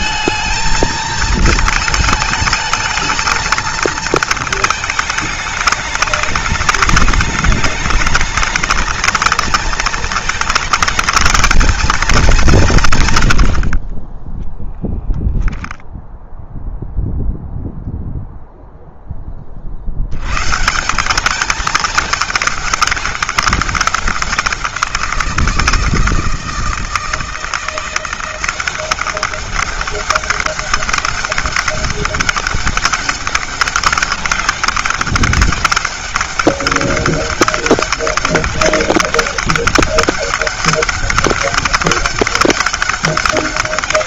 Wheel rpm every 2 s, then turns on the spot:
230, 220, 210, 210, 220, 230, 120, 10, 0, 20, 190, 200, 170, 160, 190, 200, 200, 200, 200, 200, 190, 200.
none